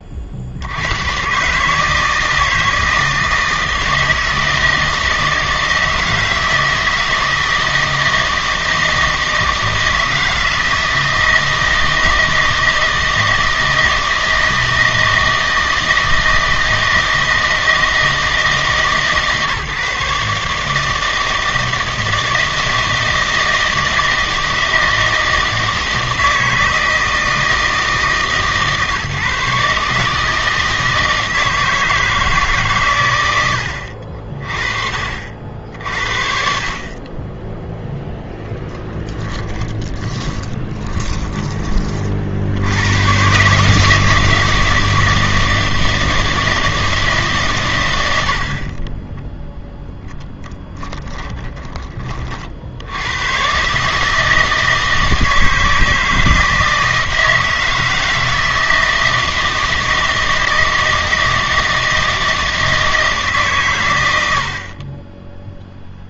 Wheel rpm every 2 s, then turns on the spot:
80, 160, 160, 160, 160, 160, 160, 160, 160, 160, 150, 160, 160, 160, 150, 160, 140, 40, 40, 10, 20, 80, 160, 160, 40, 10, 60, 160, 160, 160, 160, 160, 90.
38-42 50-52